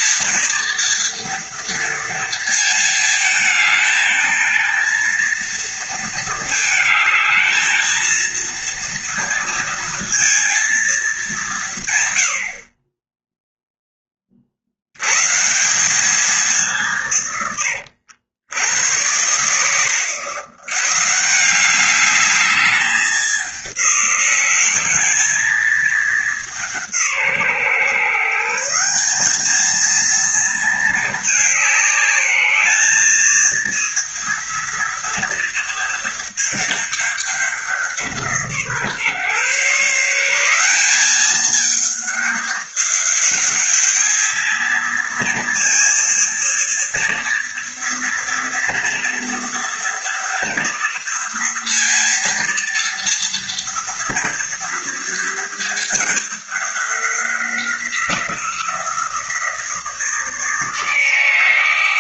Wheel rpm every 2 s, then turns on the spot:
230, 220, 230, 220, 230, 220, 30, 100, 180, 90, 130, 200, 210, 170, 180, 220, 210, 230, 210, 150, 200, 210, 230, 230, 230, 230, 230, 230, 200, 170, 160.
none